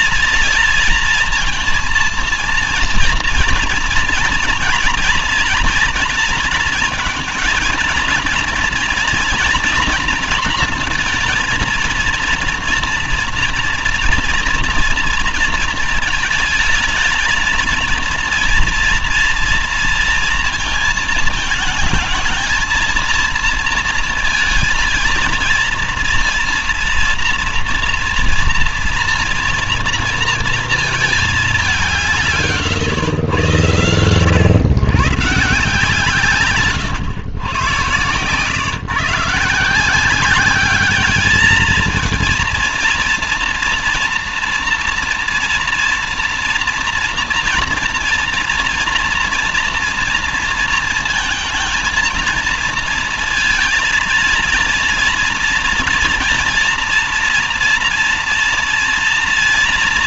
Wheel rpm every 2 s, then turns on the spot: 230, 230, 230, 230, 230, 230, 230, 230, 220, 230, 230, 230, 230, 230, 230, 230, 130, 130, 130, 130, 210, 230, 240, 240, 230, 230, 230, 230, 230, 230.
none